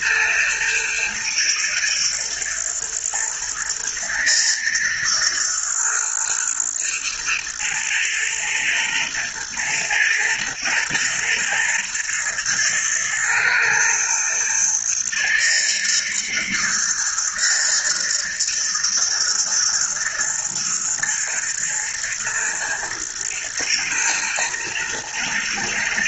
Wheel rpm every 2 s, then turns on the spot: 120, 110, 110, 110, 110, 120, 120, 120, 120, 110, 110, 120, 110.
none